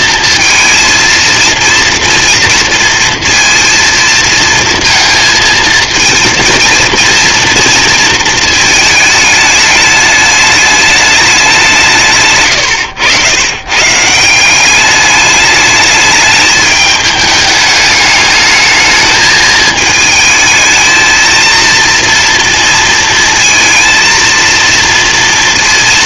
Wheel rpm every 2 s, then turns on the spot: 230, 230, 230, 230, 220, 210, 130, 190, 210, 210, 220, 230, 230.
none